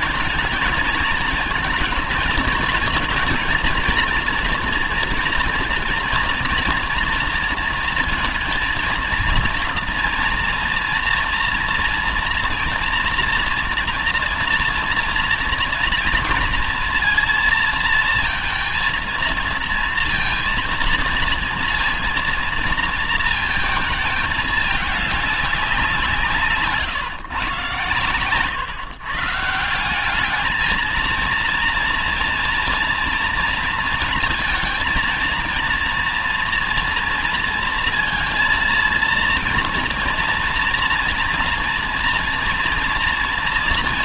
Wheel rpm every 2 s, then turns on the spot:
220, 230, 230, 230, 230, 230, 240, 240, 230, 230, 230, 230, 210, 140, 120, 210, 230, 230, 240, 230, 230, 230.
none